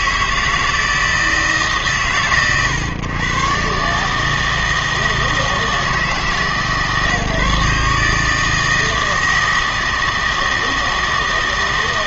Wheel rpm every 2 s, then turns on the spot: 160, 130, 150, 160, 160, 160.
none